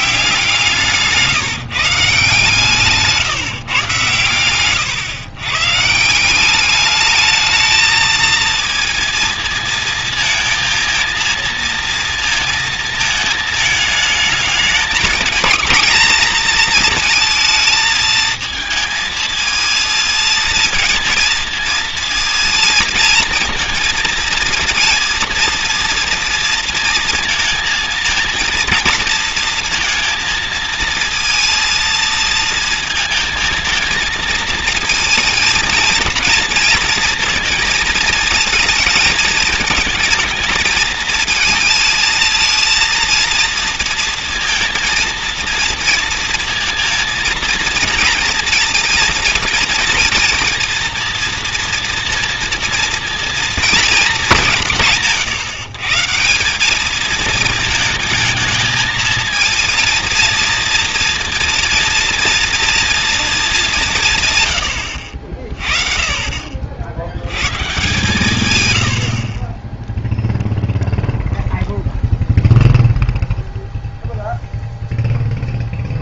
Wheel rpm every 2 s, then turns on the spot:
170, 150, 110, 200, 220, 220, 220, 220, 230, 230, 230, 230, 230, 230, 230, 230, 230, 230, 230, 220, 220, 230, 230, 230, 230, 240, 230, 180, 190, 220, 230, 230, 100, 50, 110, 0, 0, 0.
4-6